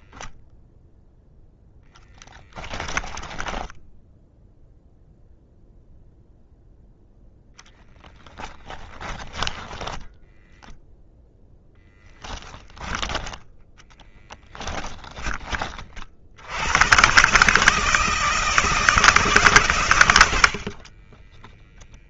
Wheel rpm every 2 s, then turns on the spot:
0, 10, 0, 0, 10, 0, 10, 10, 120, 160, 40.
2-4 12-14 20-22